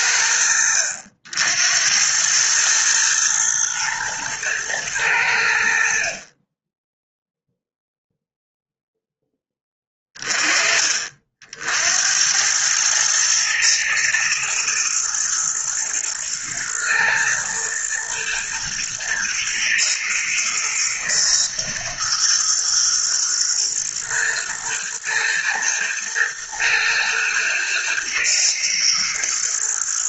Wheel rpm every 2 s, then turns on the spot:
80, 110, 110, 10, 0, 30, 100, 110, 110, 120, 120, 120, 120, 120, 110.
none